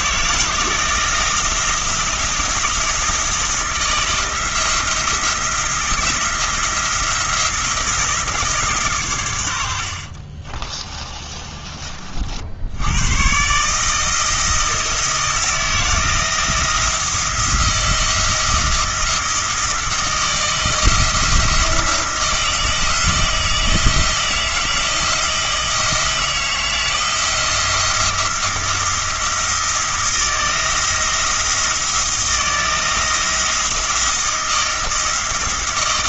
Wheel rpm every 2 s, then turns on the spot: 160, 160, 170, 170, 140, 30, 80, 160, 170, 170, 170, 160, 160, 170, 170, 170, 160, 170.
10-12